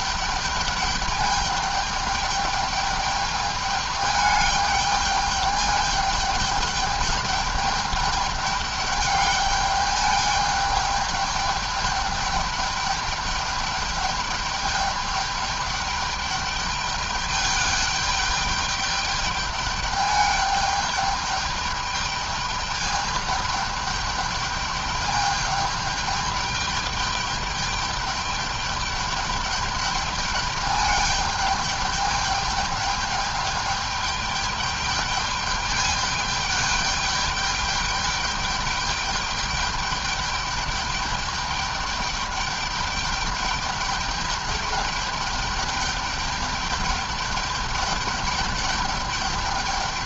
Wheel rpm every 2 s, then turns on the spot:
210, 210, 210, 210, 210, 210, 210, 210, 210, 210, 200, 210, 210, 210, 210, 210, 210, 210, 200, 210, 210, 210, 210, 210, 210.
none